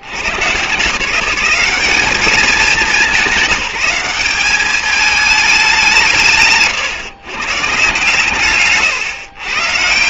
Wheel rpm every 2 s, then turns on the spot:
120, 210, 200, 130, 130.
none